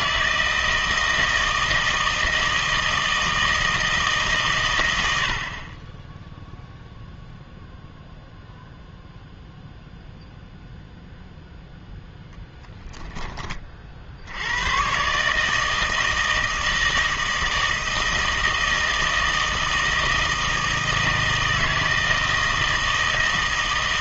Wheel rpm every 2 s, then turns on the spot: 160, 160, 110, 0, 0, 0, 10, 100, 160, 160, 160, 160.
12-14